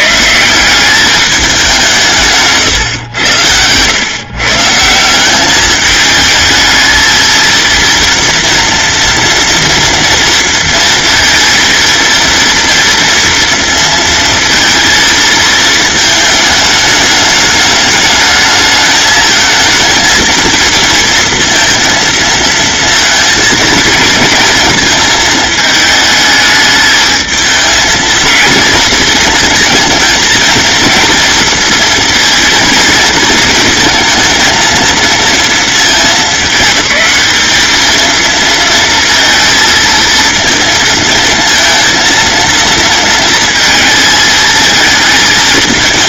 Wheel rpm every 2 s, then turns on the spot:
200, 120, 170, 220, 240, 230, 230, 230, 210, 220, 230, 220, 230, 220, 220, 230, 230, 230, 210, 230, 220, 230, 220.
none